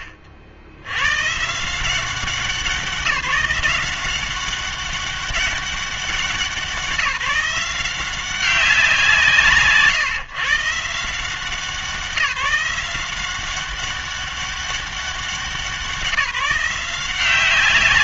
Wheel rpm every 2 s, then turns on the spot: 90, 180, 190, 180, 180, 150, 170, 200, 180.
none